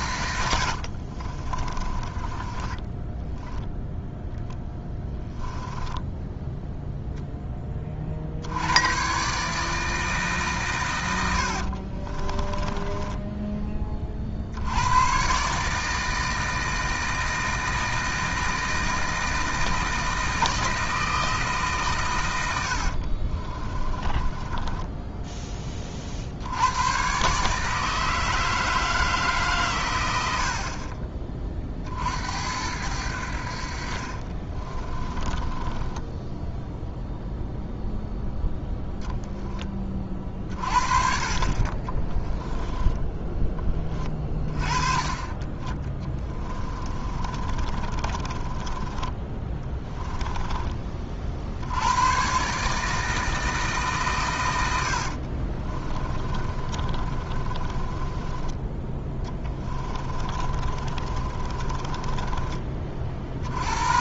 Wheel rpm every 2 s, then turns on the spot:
60, 10, 0, 0, 100, 120, 20, 90, 160, 160, 160, 70, 10, 100, 160, 40, 80, 30, 0, 0, 40, 10, 20, 30, 20, 30, 150, 80, 30, 10, 30, 40.
0-4 12-14 22-26 34-36 46-50 54-58 60-62